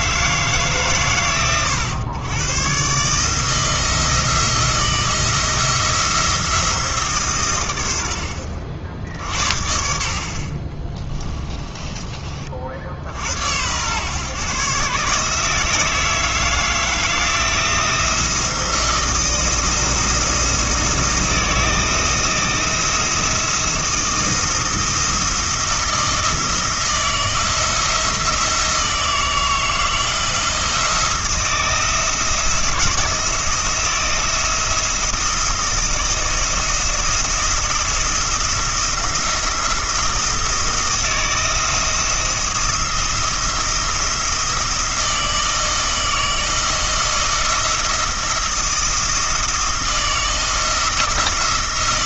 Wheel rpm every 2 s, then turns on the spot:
130, 140, 160, 160, 60, 20, 60, 140, 170, 170, 170, 170, 170, 160, 160, 170, 170, 170, 170, 170, 160, 170, 170, 170, 160, 170.
10-12